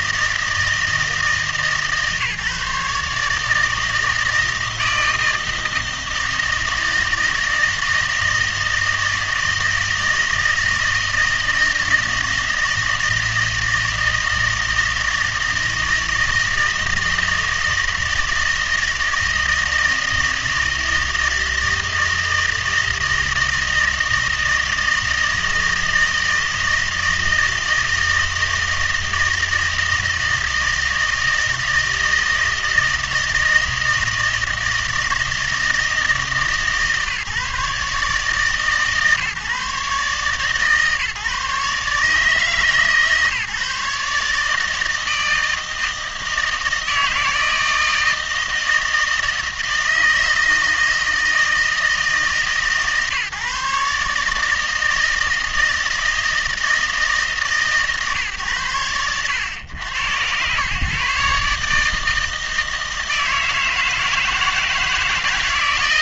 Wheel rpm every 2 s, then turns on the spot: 160, 140, 160, 160, 160, 160, 160, 160, 160, 160, 160, 160, 160, 160, 160, 160, 160, 160, 150, 150, 140, 150, 160, 160, 160, 160, 140, 160, 160, 110, 120, 160, 160.
none